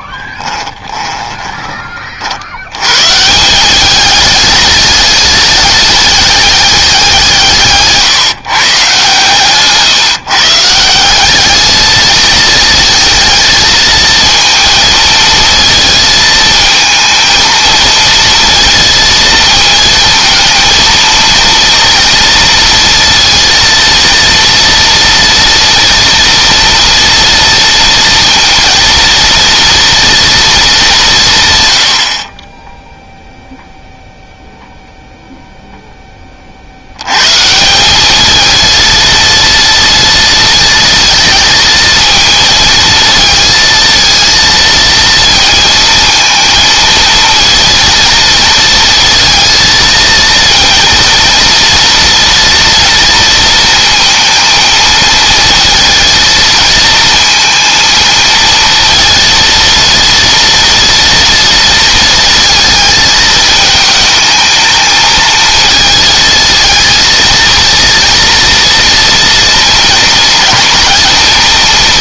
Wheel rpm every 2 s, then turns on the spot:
20, 100, 210, 190, 130, 170, 220, 220, 220, 230, 230, 230, 230, 240, 230, 200, 0, 0, 80, 220, 230, 220, 230, 220, 230, 230, 230, 230, 230, 230, 230, 220, 220, 230, 230, 220.
0-2